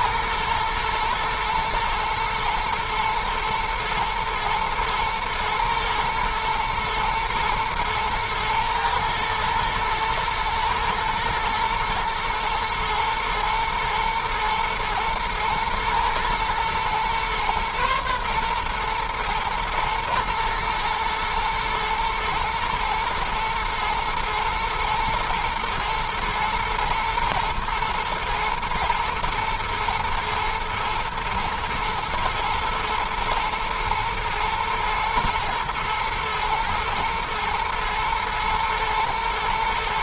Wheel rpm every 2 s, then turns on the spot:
110, 110, 120, 110, 110, 110, 110, 110, 120, 120, 120, 110, 110, 120, 110, 110, 110, 110, 110, 110.
none